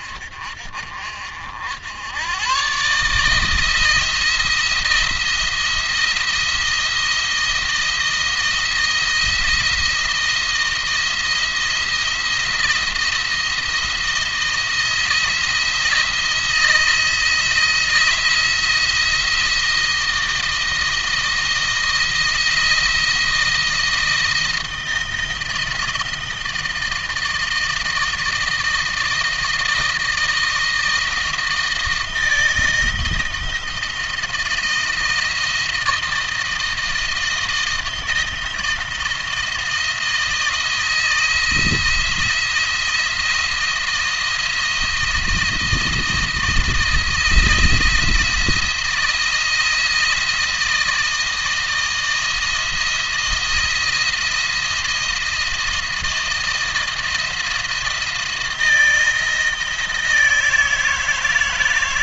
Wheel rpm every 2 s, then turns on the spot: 50, 120, 170, 160, 170, 170, 170, 170, 170, 170, 160, 170, 170, 160, 160, 160, 160, 160, 160, 160, 160, 170, 170, 160, 170, 160, 160, 170, 170, 160, 160.
none